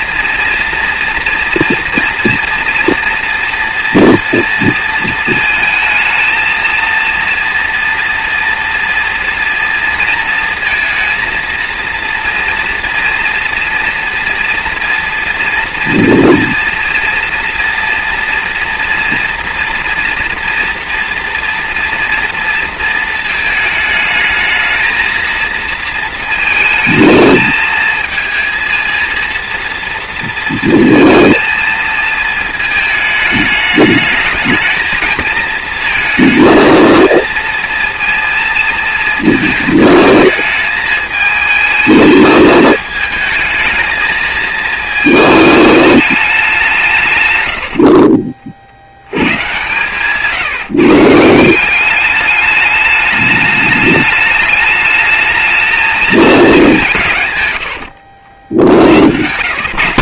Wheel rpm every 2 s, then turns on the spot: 230, 230, 230, 230, 240, 230, 230, 230, 230, 240, 240, 230, 220, 220, 220, 230, 220, 220, 230, 220, 220, 220, 220, 130, 100, 150, 210, 210, 140, 110.
none